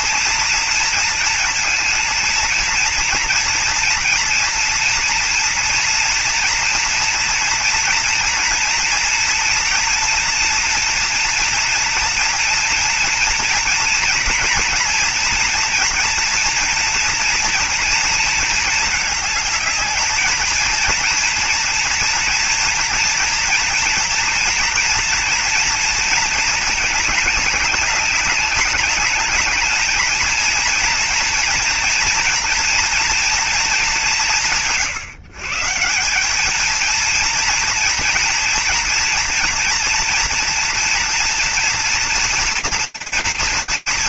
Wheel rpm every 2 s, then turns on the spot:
230, 230, 230, 230, 230, 240, 230, 230, 230, 230, 220, 230, 230, 220, 200, 230, 230, 160, 210, 230, 240, 230.
none